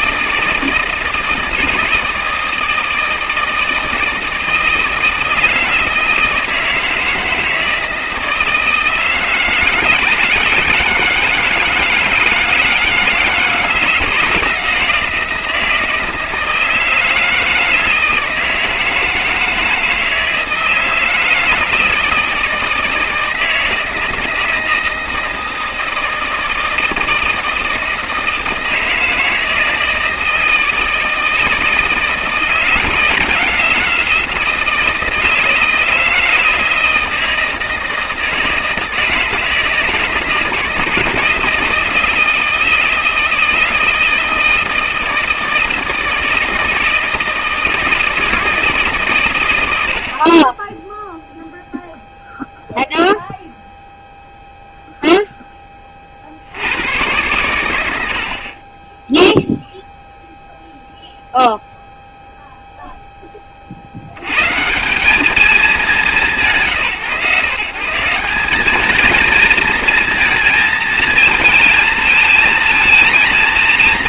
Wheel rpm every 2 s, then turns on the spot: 160, 160, 160, 160, 160, 160, 160, 170, 160, 160, 160, 160, 160, 160, 160, 160, 160, 170, 160, 160, 160, 160, 160, 160, 150, 10, 0, 0, 90, 20, 0, 0, 170, 160, 210, 220, 230.
none